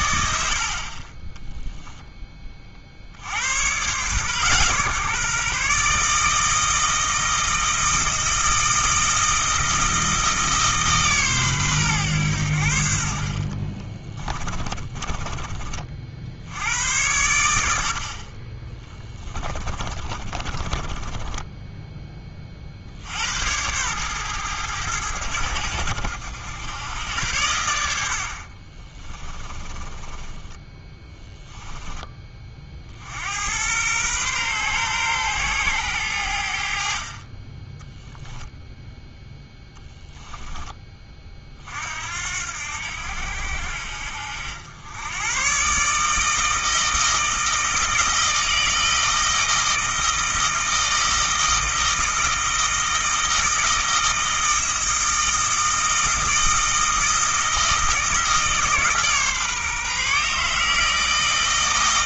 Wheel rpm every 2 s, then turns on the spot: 50, 40, 140, 160, 160, 150, 70, 20, 80, 20, 40, 50, 100, 90, 40, 10, 50, 120, 60, 0, 20, 80, 80, 160, 160, 160, 160, 160, 160, 150, 160.
14-16 18-22 28-32